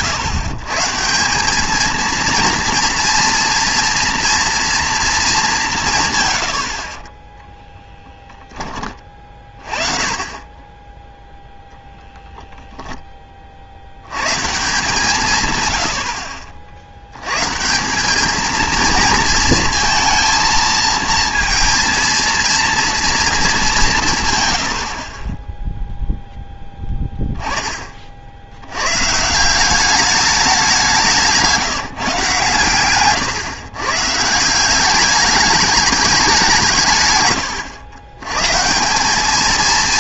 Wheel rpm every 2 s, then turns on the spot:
140, 230, 230, 50, 20, 10, 10, 150, 70, 220, 230, 230, 80, 10, 100, 190, 110, 200, 150, 170.
none